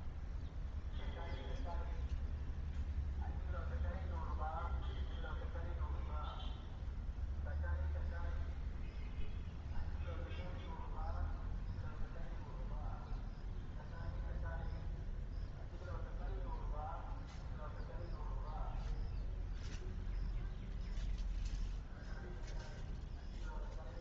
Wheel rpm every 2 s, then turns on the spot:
0, 0, 0, 0, 0, 0, 0, 0, 0, 0, 0, 0.
none